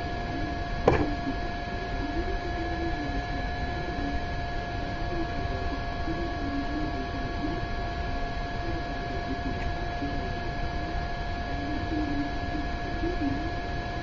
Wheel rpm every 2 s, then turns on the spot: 0, 0, 0, 0, 0, 0, 0.
none